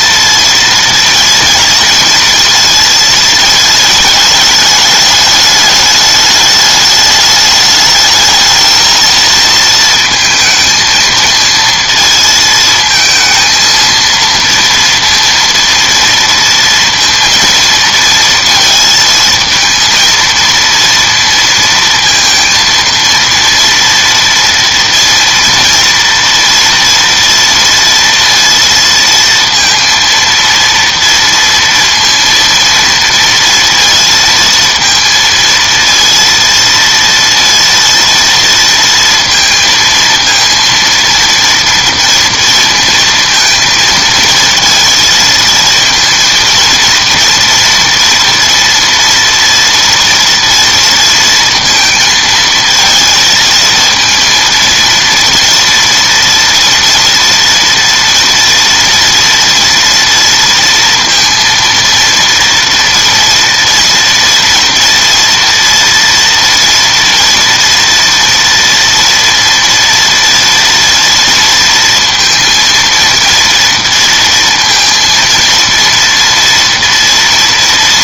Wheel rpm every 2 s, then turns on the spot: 230, 230, 210, 210, 220, 230, 220, 230, 230, 230, 230, 230, 230, 230, 230, 230, 230, 230, 230, 230, 230, 230, 230, 230, 240, 230, 220, 230, 230, 240, 230, 240, 240, 230, 230, 230, 230, 230, 230.
none